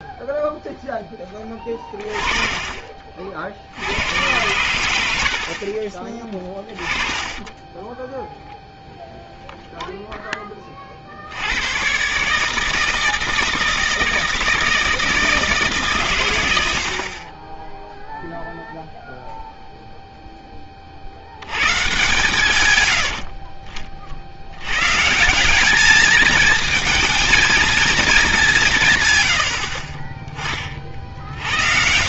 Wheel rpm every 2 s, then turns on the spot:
0, 30, 90, 30, 0, 30, 160, 160, 80, 0, 20, 100, 120, 220, 180, 40.
6-8 30-32